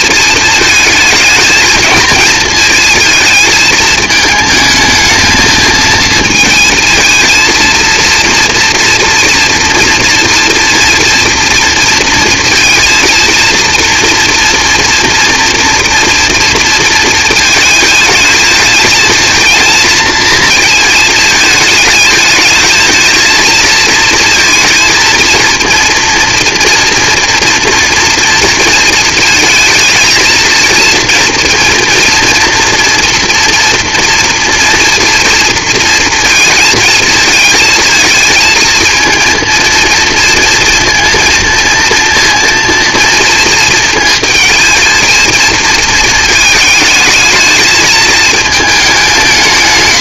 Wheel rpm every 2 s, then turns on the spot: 220, 220, 220, 220, 230, 230, 230, 230, 230, 220, 220, 220, 230, 230, 230, 230, 240, 230, 230, 230, 230, 230, 220, 220, 220.
none